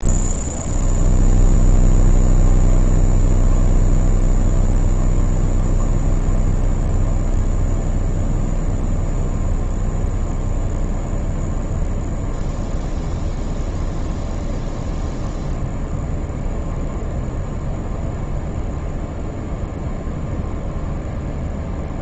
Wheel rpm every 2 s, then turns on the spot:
0, 0, 0, 0, 0, 0, 0, 0, 0, 0, 0.
none